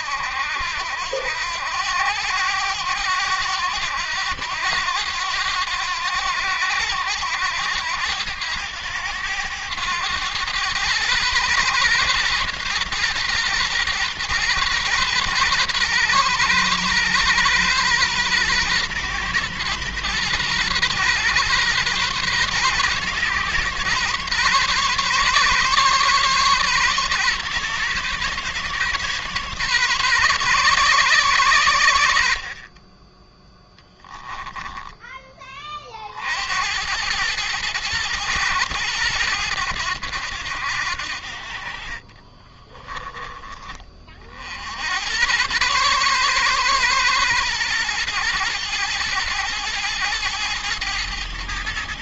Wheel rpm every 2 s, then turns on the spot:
80, 90, 90, 90, 100, 110, 120, 120, 120, 120, 120, 130, 140, 130, 140, 140, 40, 10, 90, 110, 80, 20, 80, 130, 110, 110.
42-44